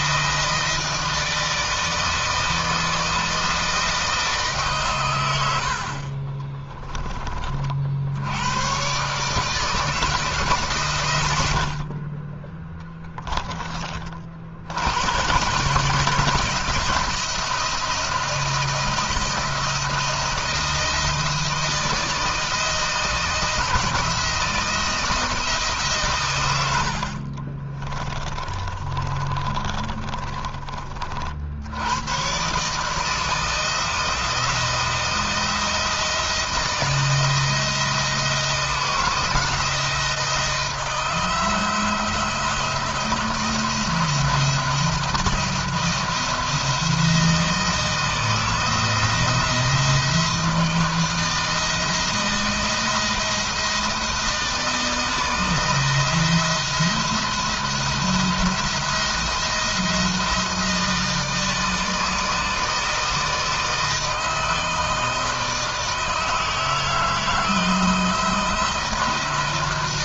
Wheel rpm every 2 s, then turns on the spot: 160, 160, 130, 30, 130, 120, 10, 120, 170, 170, 170, 160, 170, 70, 30, 50, 160, 170, 160, 170, 170, 170, 170, 160, 170, 160, 170, 160, 170, 170, 160, 160, 160, 160, 170.
26-30